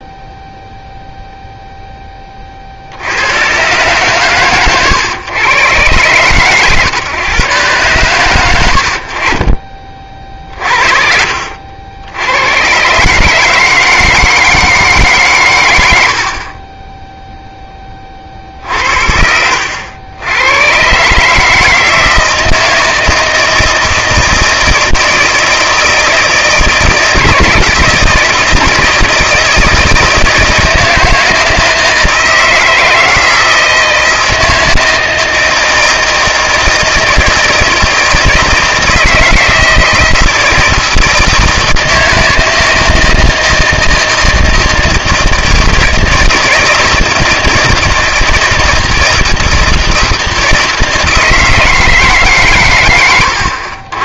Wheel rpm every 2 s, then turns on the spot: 0, 50, 120, 120, 90, 40, 120, 160, 20, 60, 110, 160, 160, 160, 170, 160, 160, 160, 160, 160, 160, 160, 160, 160, 160, 160, 120.
none